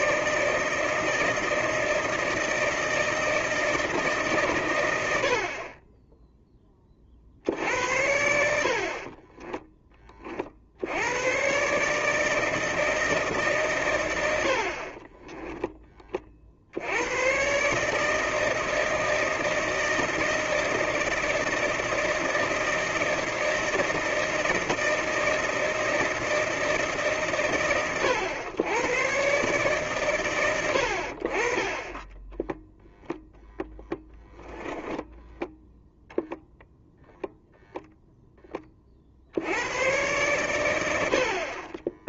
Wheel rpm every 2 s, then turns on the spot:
160, 160, 120, 10, 60, 50, 160, 70, 50, 160, 160, 160, 160, 160, 100, 100, 10, 10, 0, 20, 100.
34-36